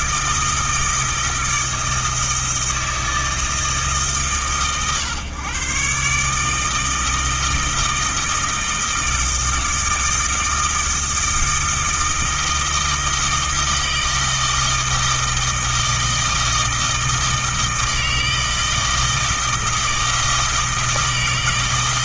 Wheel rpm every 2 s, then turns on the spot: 160, 160, 130, 160, 160, 160, 160, 160, 160, 160, 160.
none